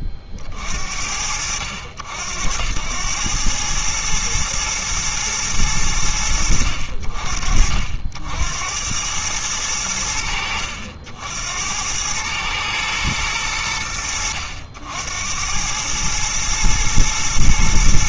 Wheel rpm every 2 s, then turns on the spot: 30, 80, 110, 70, 80, 60, 110, 80, 110.
none